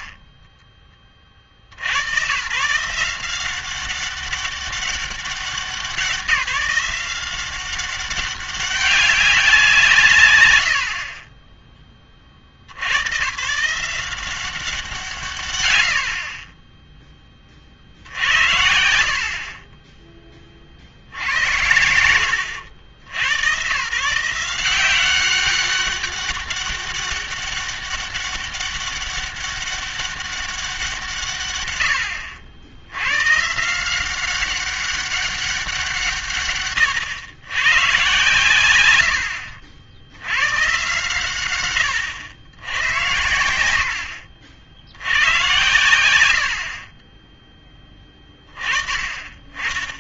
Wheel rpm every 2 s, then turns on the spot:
20, 160, 200, 180, 190, 90, 70, 180, 10, 80, 60, 70, 180, 200, 200, 180, 90, 190, 120, 90, 130, 110, 80, 60, 30.
none